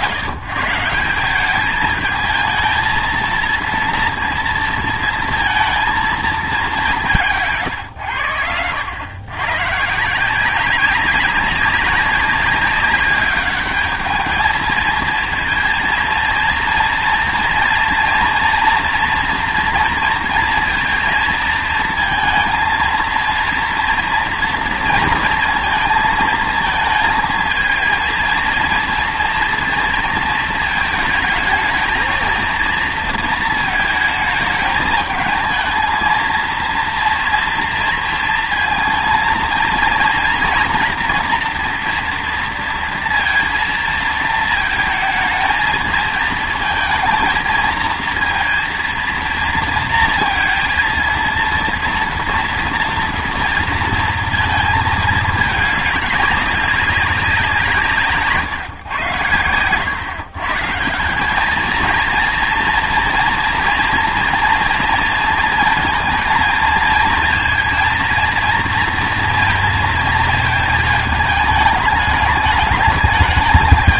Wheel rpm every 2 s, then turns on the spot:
130, 220, 230, 210, 90, 190, 190, 220, 230, 230, 230, 230, 230, 220, 230, 220, 230, 220, 230, 230, 230, 230, 220, 230, 230, 230, 230, 220, 200, 130, 130, 230, 230, 230, 230, 220, 210.
none